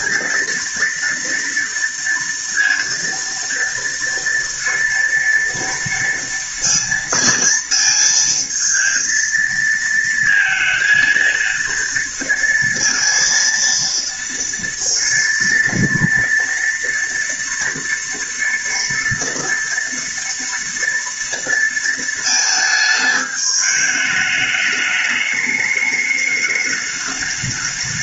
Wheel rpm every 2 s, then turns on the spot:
240, 230, 230, 230, 230, 230, 230, 230, 230, 230, 230, 220, 210, 210.
none